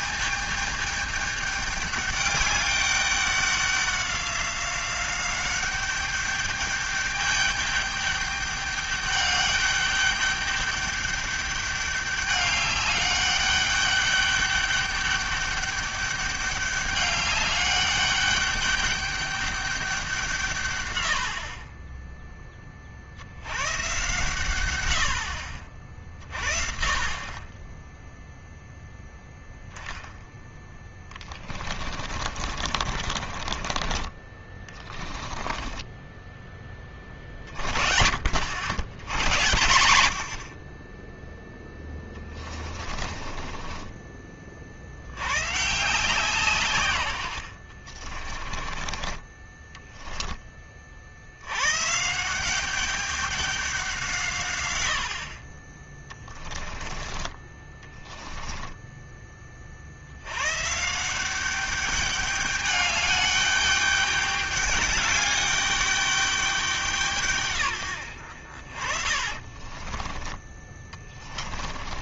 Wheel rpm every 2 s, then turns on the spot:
210, 200, 190, 200, 210, 210, 200, 200, 200, 200, 140, 30, 90, 50, 0, 10, 40, 20, 20, 80, 40, 30, 50, 140, 30, 40, 190, 110, 20, 10, 140, 210, 210, 190, 60, 30.
30-36 42-44 48-50 54-56 58-60 70-72